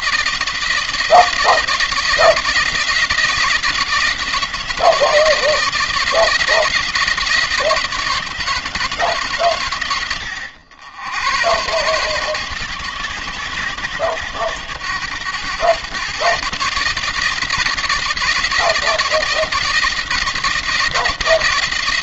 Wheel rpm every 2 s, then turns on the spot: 170, 170, 170, 170, 160, 100, 120, 110, 160, 170, 170.
none